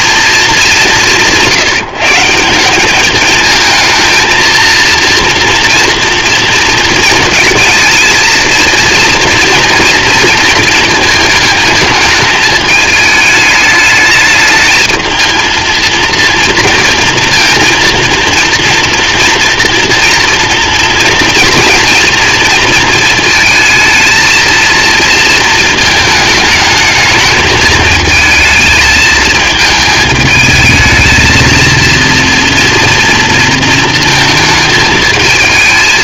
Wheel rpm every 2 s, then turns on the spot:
180, 210, 230, 230, 230, 220, 210, 220, 230, 230, 230, 220, 230, 220, 220, 220, 230, 220.
none